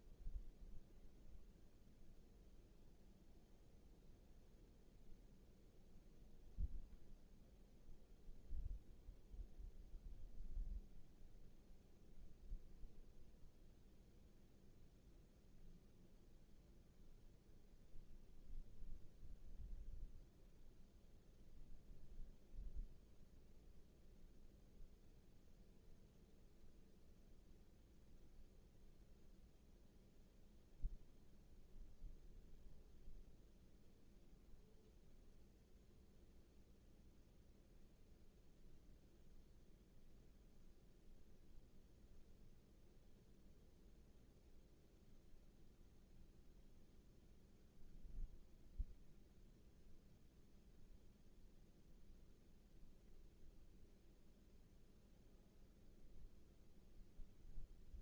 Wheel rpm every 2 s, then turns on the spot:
0, 0, 0, 0, 0, 0, 0, 0, 0, 0, 0, 0, 0, 0, 0, 0, 0, 0, 0, 0, 0, 0, 0, 0, 0, 0, 0, 0, 0.
none